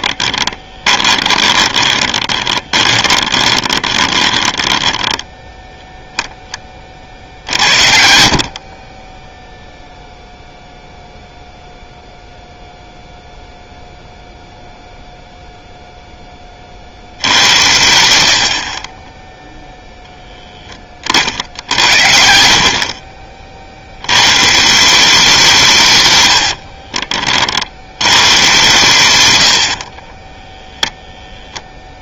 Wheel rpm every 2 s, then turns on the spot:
20, 20, 10, 30, 30, 0, 0, 0, 50, 30, 20, 50, 160, 40, 120, 0.
0-6 26-28